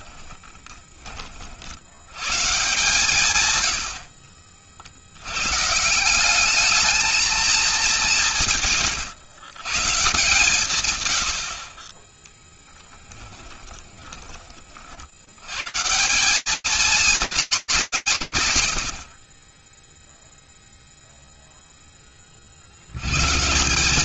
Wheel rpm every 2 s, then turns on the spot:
80, 60, 160, 200, 140, 30, 20, 180, 210, 60, 0, 170.
none